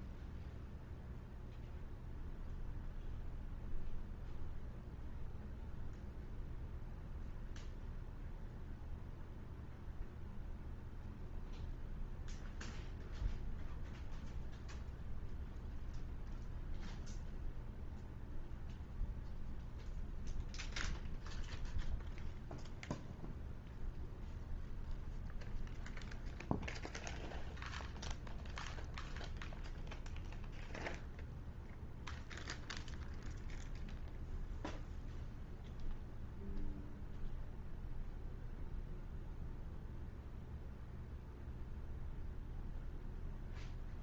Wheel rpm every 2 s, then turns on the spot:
0, 0, 0, 0, 0, 0, 0, 0, 0, 0, 0, 0, 0, 0, 0, 0, 0, 0, 0, 0, 0, 0.
none